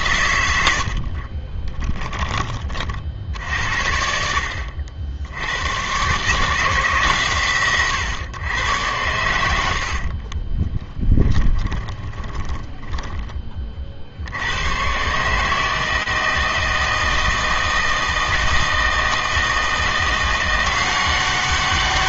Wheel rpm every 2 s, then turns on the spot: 80, 30, 60, 150, 110, 40, 10, 100, 160, 160, 180.
0-2 10-14